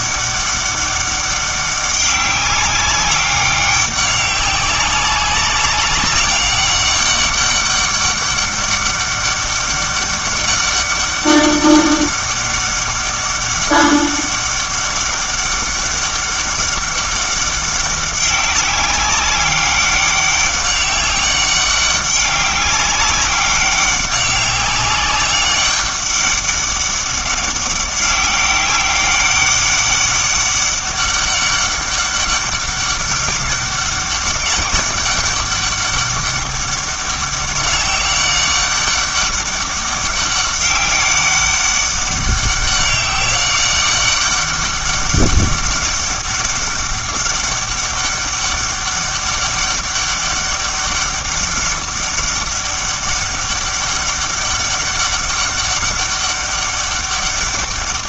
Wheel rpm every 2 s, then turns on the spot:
200, 190, 190, 200, 200, 200, 200, 200, 200, 190, 200, 200, 200, 200, 200, 200, 200, 190, 190, 200, 200, 200, 200, 200, 200, 200, 200, 200, 200.
none